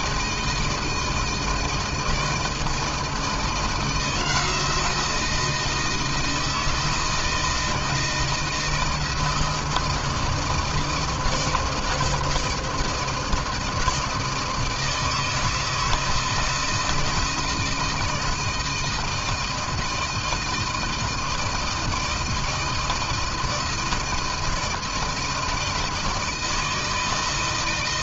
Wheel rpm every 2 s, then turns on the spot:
160, 170, 170, 160, 160, 160, 160, 160, 160, 160, 160, 160, 160, 160.
none